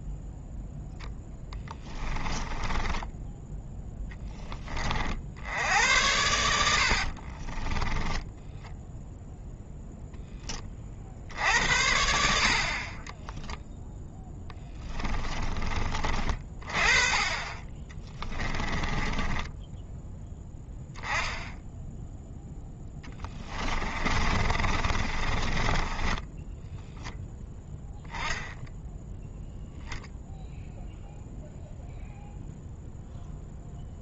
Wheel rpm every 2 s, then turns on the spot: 0, 10, 30, 80, 0, 30, 40, 10, 30, 20, 0, 10, 40, 10, 0, 0, 0.
2-4 14-16 18-20 22-26